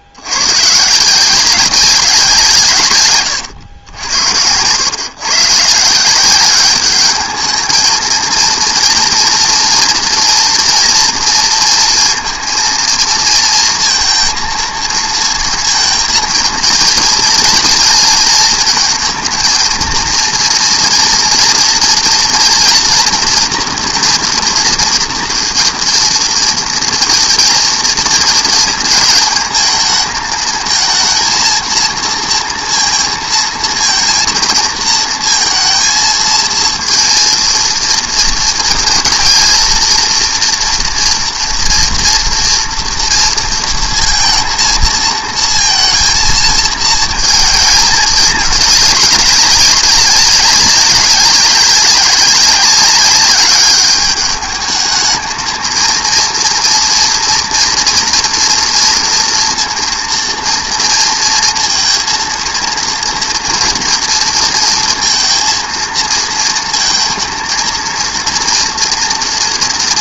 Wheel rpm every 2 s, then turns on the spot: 110, 160, 90, 200, 230, 230, 230, 220, 230, 230, 230, 240, 230, 230, 230, 220, 230, 230, 230, 230, 240, 230, 230, 230, 210, 200, 200, 210, 230, 230, 230, 230, 230, 220, 230.
none